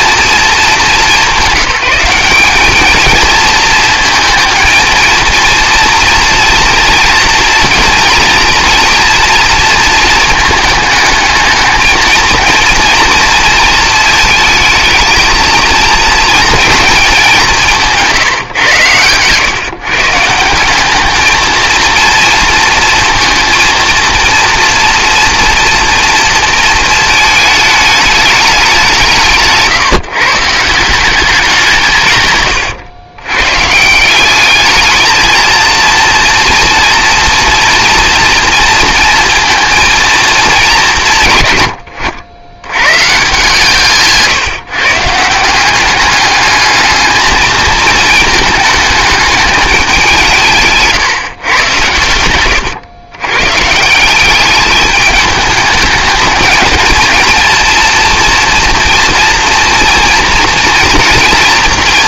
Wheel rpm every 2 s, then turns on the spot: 220, 200, 230, 230, 230, 220, 230, 230, 230, 120, 180, 230, 230, 230, 200, 160, 110, 210, 240, 230, 210, 110, 140, 210, 220, 160, 110, 200, 220, 230, 240.
52-54